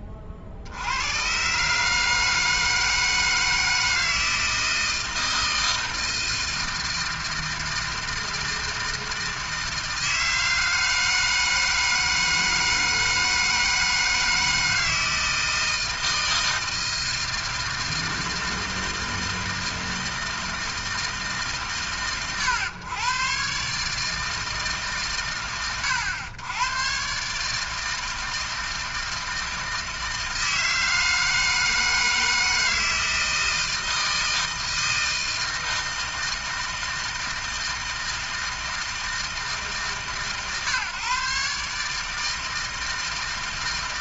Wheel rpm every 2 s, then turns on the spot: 70, 160, 160, 160, 160, 160, 160, 160, 160, 160, 160, 110, 140, 120, 160, 160, 160, 160, 160, 160, 130, 160.
none